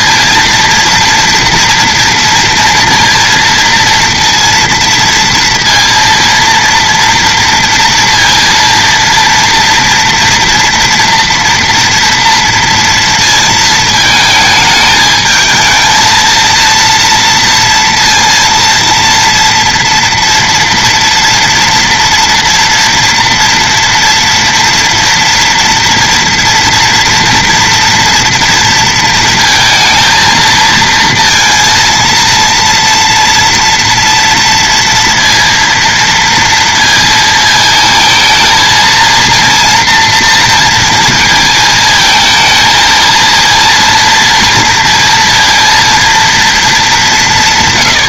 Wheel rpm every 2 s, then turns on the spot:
230, 230, 230, 230, 230, 240, 230, 220, 230, 230, 230, 230, 230, 240, 230, 220, 230, 230, 230, 220, 230, 220, 230, 230.
none